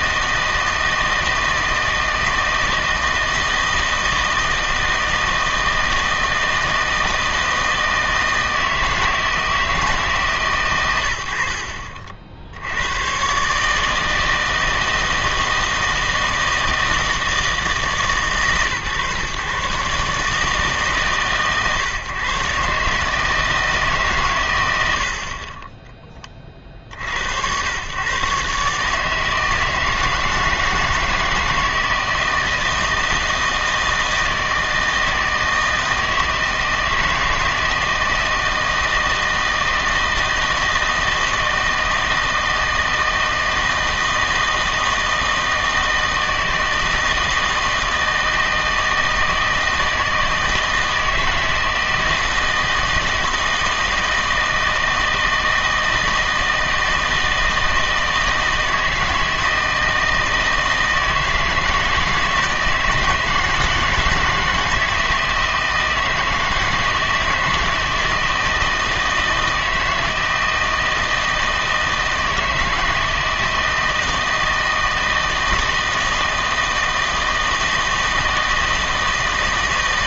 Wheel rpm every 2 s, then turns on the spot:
160, 160, 160, 160, 160, 120, 100, 160, 160, 130, 150, 140, 80, 60, 150, 160, 160, 160, 160, 160, 160, 160, 160, 160, 160, 160, 160, 160, 160, 160, 160, 160, 160, 160, 160, 160, 160, 160, 160, 160.
none